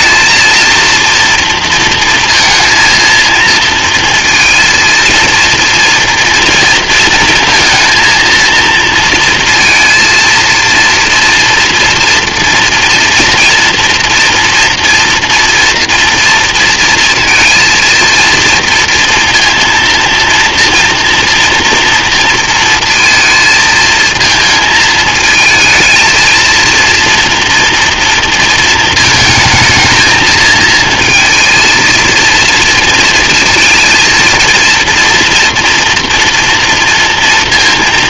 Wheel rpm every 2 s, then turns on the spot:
230, 230, 230, 230, 230, 230, 240, 230, 230, 230, 230, 230, 220, 230, 220, 220, 230, 230, 230.
none